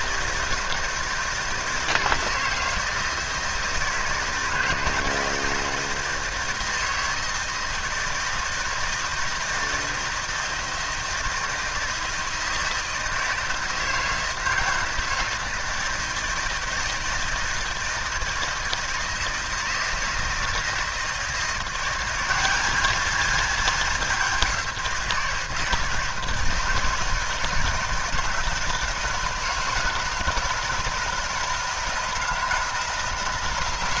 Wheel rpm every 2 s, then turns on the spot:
160, 160, 160, 160, 160, 160, 160, 160, 160, 160, 160, 210, 180, 160, 160, 170, 160.
none